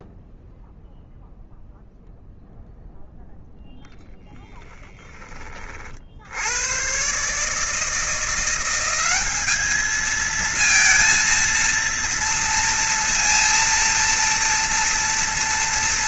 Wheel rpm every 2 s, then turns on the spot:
0, 0, 10, 90, 180, 220, 230, 230.
none